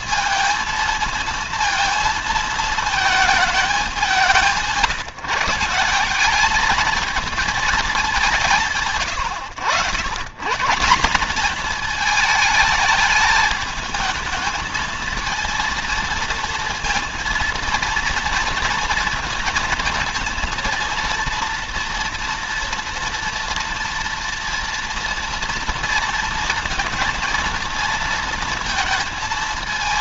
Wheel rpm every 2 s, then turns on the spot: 230, 220, 180, 220, 140, 150, 220, 220, 230, 230, 230, 230, 230, 230, 230.
none